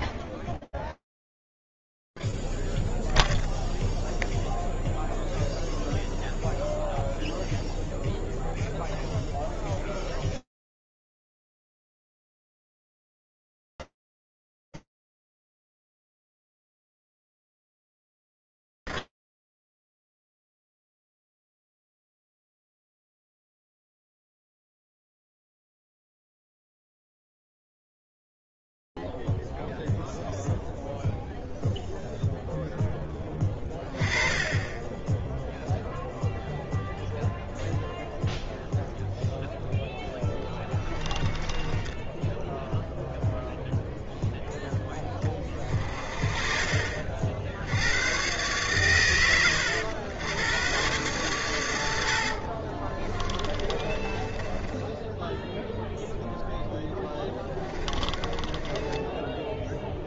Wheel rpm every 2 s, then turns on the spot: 0, 0, 0, 0, 0, 0, 0, 0, 0, 0, 0, 0, 0, 0, 0, 0, 0, 20, 0, 0, 10, 0, 0, 40, 120, 110, 50, 20, 10, 20.
34-36 40-42 52-56 58-60